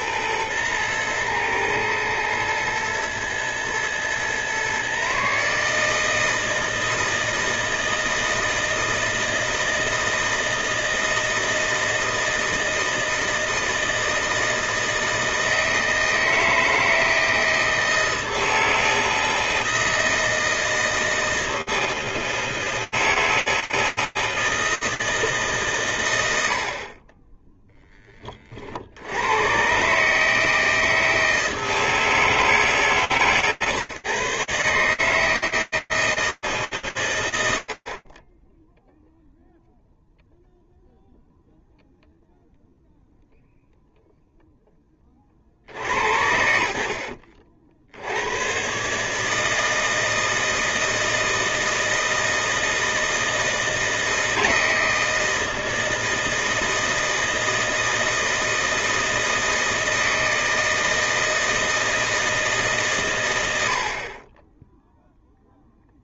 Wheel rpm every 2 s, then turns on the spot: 110, 110, 120, 160, 160, 160, 160, 160, 160, 160, 160, 160, 160, 50, 60, 160, 150, 150, 110, 0, 0, 0, 60, 70, 160, 160, 160, 160, 160, 160, 160, 80, 0.
none